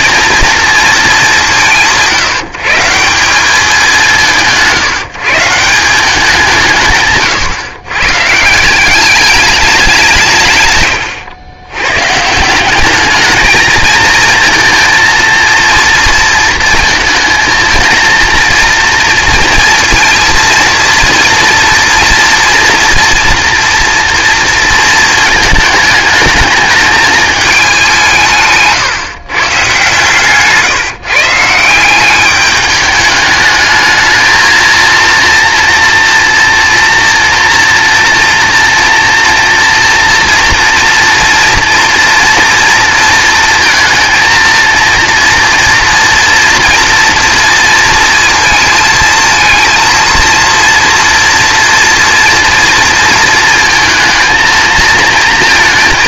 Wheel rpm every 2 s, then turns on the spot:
220, 170, 160, 150, 180, 120, 200, 230, 230, 230, 230, 230, 230, 210, 150, 140, 210, 230, 230, 230, 230, 230, 230, 230, 230, 230, 230, 230.
none